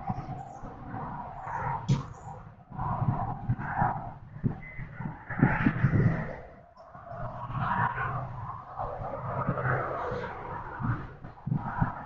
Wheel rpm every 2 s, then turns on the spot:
0, 0, 0, 0, 0, 0.
none